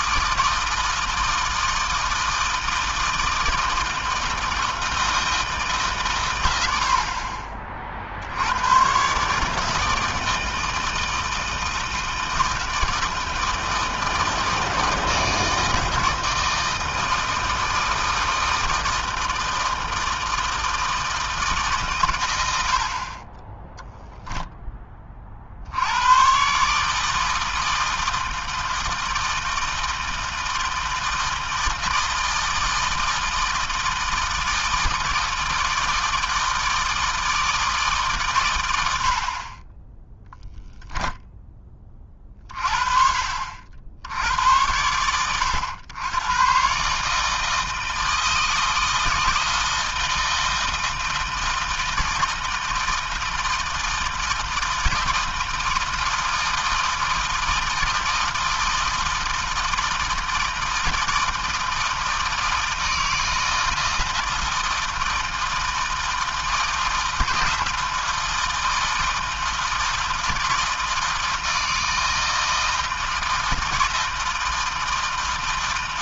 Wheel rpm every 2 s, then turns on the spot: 160, 160, 160, 50, 130, 160, 160, 160, 160, 160, 160, 40, 30, 160, 160, 160, 160, 160, 160, 70, 10, 40, 100, 150, 160, 160, 160, 160, 160, 160, 160, 160, 160, 160, 160, 160, 170, 160.
none